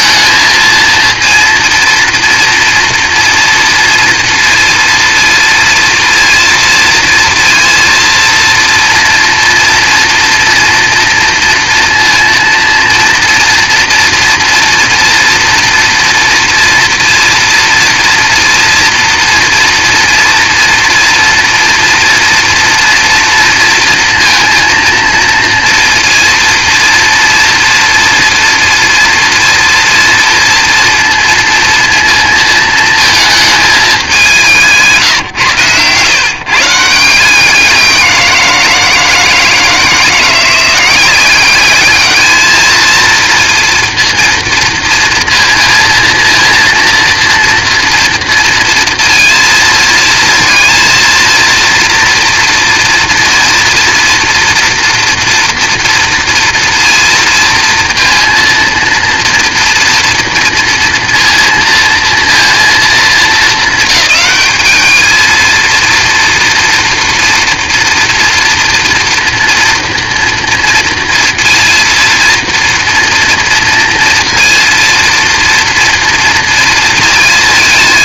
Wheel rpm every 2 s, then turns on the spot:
230, 230, 230, 230, 230, 230, 230, 230, 230, 230, 230, 240, 230, 230, 230, 230, 230, 180, 140, 170, 180, 220, 230, 230, 230, 230, 230, 230, 230, 230, 230, 230, 210, 230, 230, 230, 240, 230, 230.
none